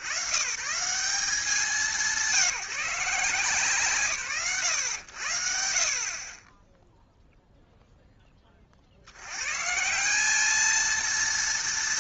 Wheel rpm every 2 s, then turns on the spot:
110, 170, 90, 10, 70, 220.
none